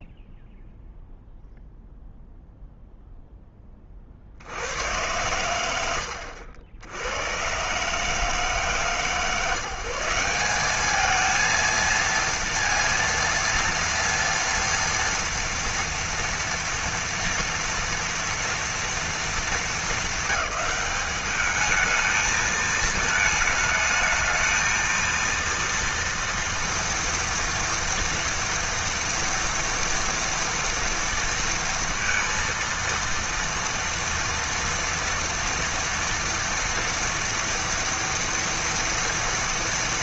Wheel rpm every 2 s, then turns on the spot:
0, 0, 60, 80, 150, 190, 230, 230, 230, 230, 200, 220, 220, 230, 230, 230, 230, 230, 230, 230.
none